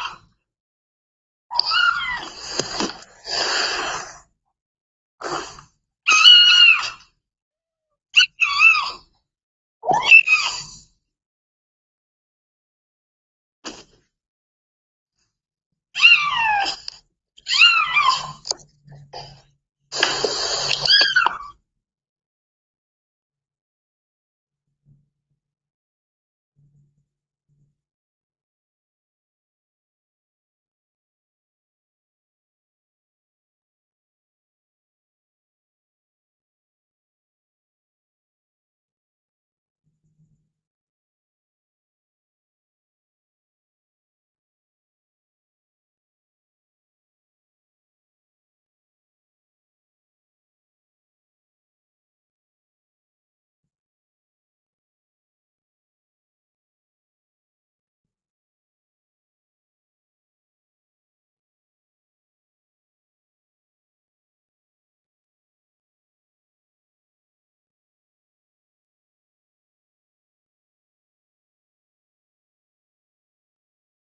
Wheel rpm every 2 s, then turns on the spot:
0, 0, 0, 0, 0, 0, 0, 0, 0, 0, 0, 0, 0, 0, 0, 0, 0, 0, 0, 0, 0, 0, 0, 0, 0, 0, 0, 0, 0, 0, 0, 0, 0, 0, 0, 0, 0.
none